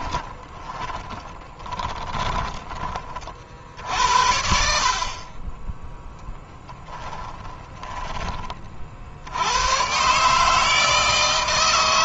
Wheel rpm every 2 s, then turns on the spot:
20, 30, 40, 20, 60, 160.
0-2 6-8